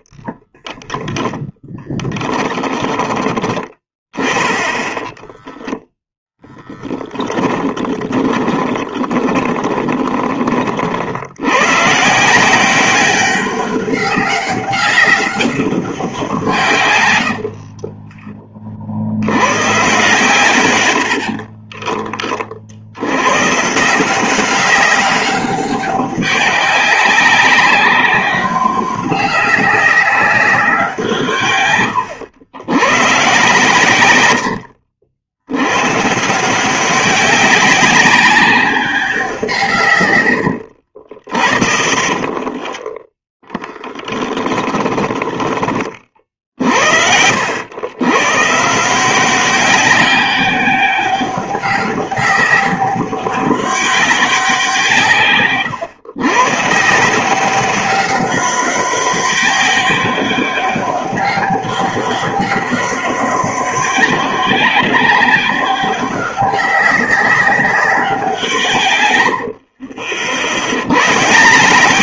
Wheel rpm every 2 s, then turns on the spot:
20, 10, 10, 10, 20, 30, 170, 200, 150, 30, 110, 40, 190, 200, 200, 190, 100, 80, 170, 200, 90, 30, 30, 40, 140, 200, 200, 180, 140, 200, 200, 200, 200, 200, 170, 80.
0-4 6-10 34-36 40-46